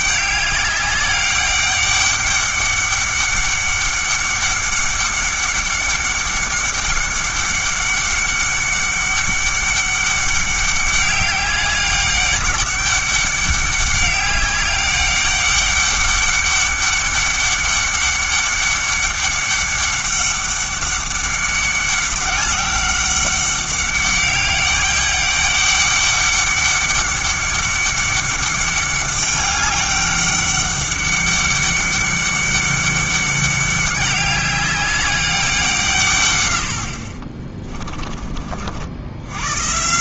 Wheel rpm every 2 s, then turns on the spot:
200, 200, 200, 200, 200, 200, 200, 200, 200, 200, 200, 200, 200, 200, 200, 200, 200, 200, 90, 80.
none